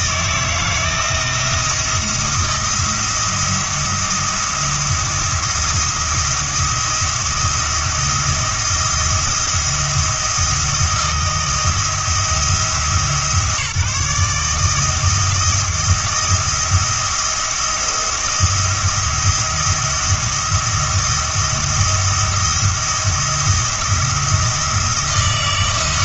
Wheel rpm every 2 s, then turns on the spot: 170, 170, 170, 170, 170, 170, 160, 160, 170, 170, 170, 170, 170.
none